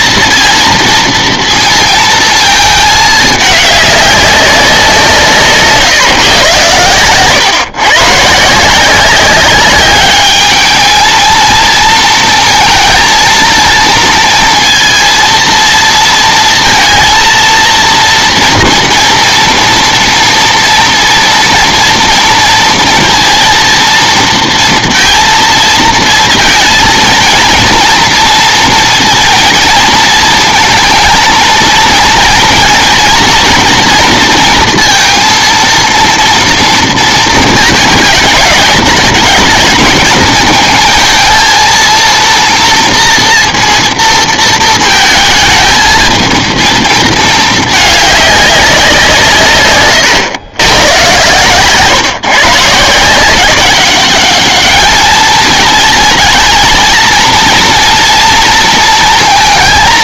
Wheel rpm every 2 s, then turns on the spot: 230, 220, 190, 110, 160, 220, 230, 230, 230, 230, 230, 230, 230, 230, 230, 230, 220, 230, 230, 210, 220, 230, 230, 230, 190, 120, 150, 210, 220, 230.
none